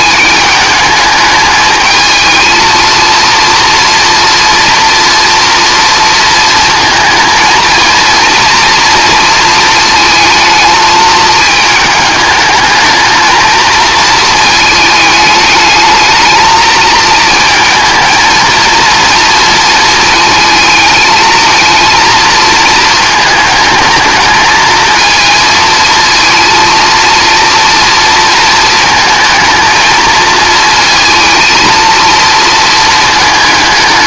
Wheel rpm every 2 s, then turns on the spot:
210, 220, 240, 220, 230, 220, 220, 220, 220, 230, 220, 220, 220, 230, 220, 230, 230.
none